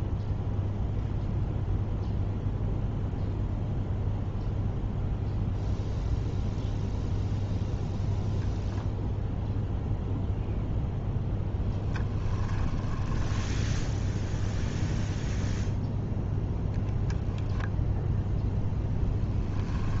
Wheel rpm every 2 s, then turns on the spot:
0, 0, 0, 0, 0, 0, 10, 0, 0, 0.
12-14